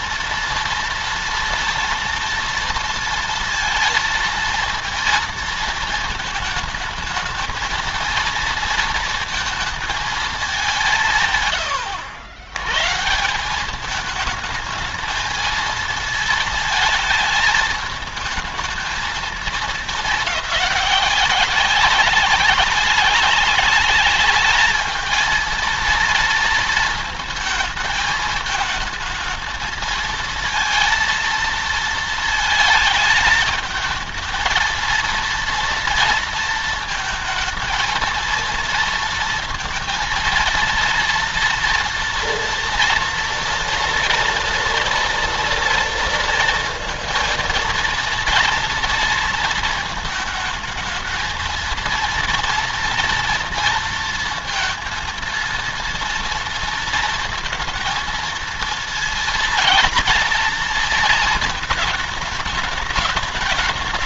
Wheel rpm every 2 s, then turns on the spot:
230, 230, 230, 220, 230, 190, 110, 220, 220, 220, 190, 190, 210, 230, 220, 230, 220, 230, 230, 230, 230, 240, 230, 230, 230, 220, 230, 230, 230, 220, 230, 210.
none